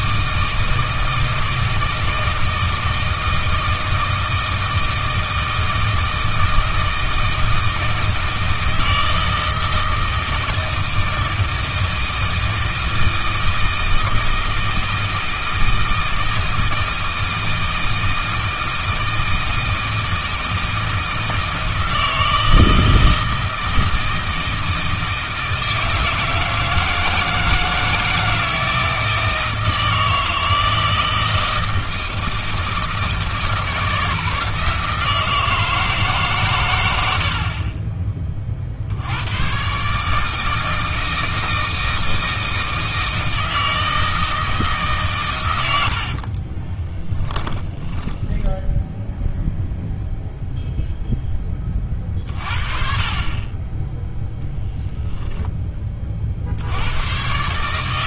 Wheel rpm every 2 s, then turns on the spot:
160, 160, 160, 160, 160, 160, 160, 160, 160, 160, 160, 160, 160, 160, 160, 160, 160, 160, 90, 60, 160, 160, 150, 10, 0, 0, 40, 10, 90.
46-48